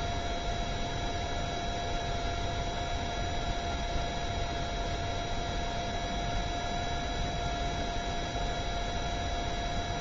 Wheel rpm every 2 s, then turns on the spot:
0, 0, 0, 0, 0.
none